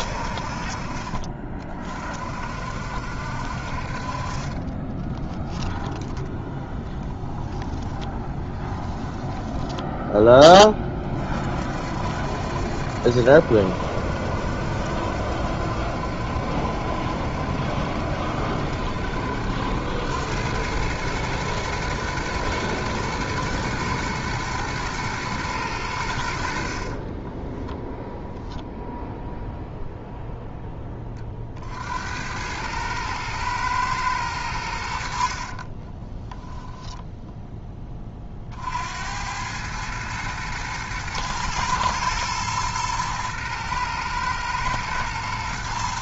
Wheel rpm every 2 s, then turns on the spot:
40, 60, 10, 10, 10, 40, 70, 70, 70, 70, 110, 120, 110, 40, 0, 20, 110, 70, 10, 80, 110, 110, 120.
8-10 26-28 34-38